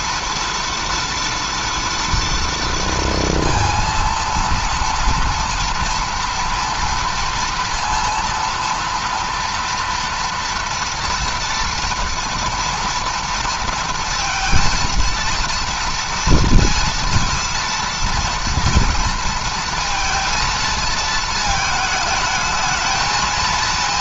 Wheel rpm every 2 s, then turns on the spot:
240, 230, 230, 230, 230, 230, 240, 230, 230, 230, 220, 220.
none